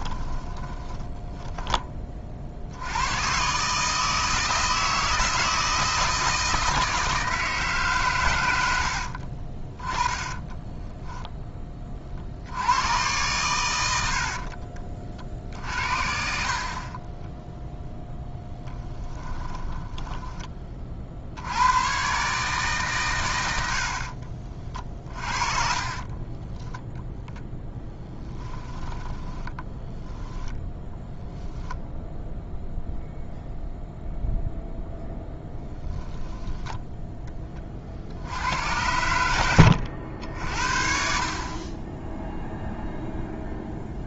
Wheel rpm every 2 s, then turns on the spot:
20, 110, 160, 160, 60, 10, 120, 60, 20, 10, 40, 130, 40, 0, 10, 0, 0, 0, 10, 80, 60, 0.
0-2 8-10 16-20 24-26 28-30